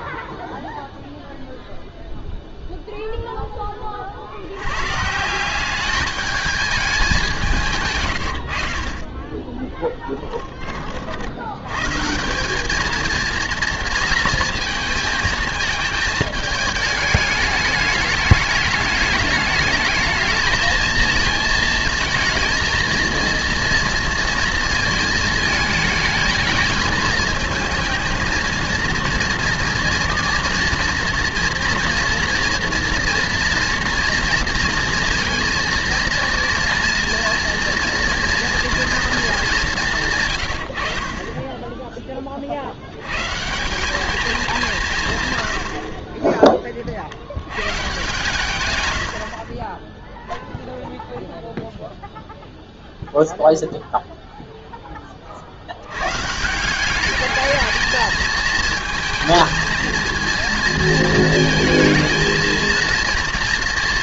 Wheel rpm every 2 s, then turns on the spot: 0, 0, 120, 210, 60, 30, 210, 220, 220, 210, 220, 230, 220, 220, 230, 230, 240, 230, 230, 230, 90, 60, 180, 30, 110, 0, 0, 0, 180, 220, 220, 230.
none